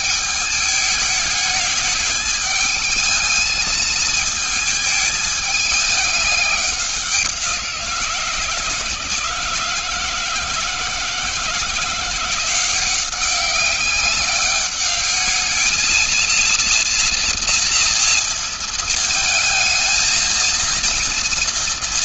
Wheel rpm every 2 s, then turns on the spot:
210, 210, 220, 200, 170, 170, 180, 200, 230, 230, 230.
none